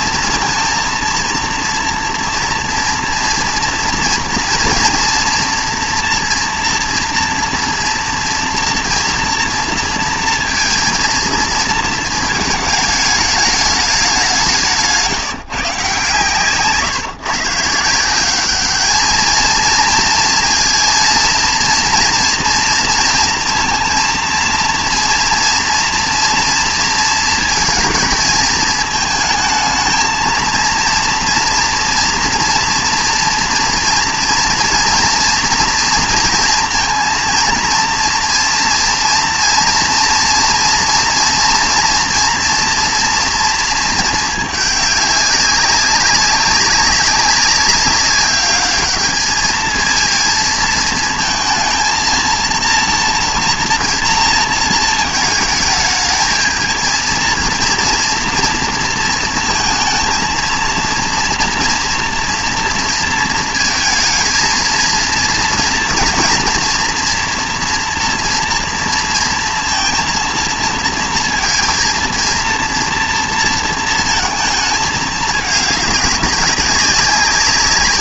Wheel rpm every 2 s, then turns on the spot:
230, 230, 230, 240, 230, 230, 220, 160, 140, 210, 230, 230, 230, 230, 220, 230, 240, 230, 230, 230, 230, 240, 210, 200, 200, 230, 230, 230, 220, 230, 230, 230, 230, 230, 230, 230, 230, 220, 200.
none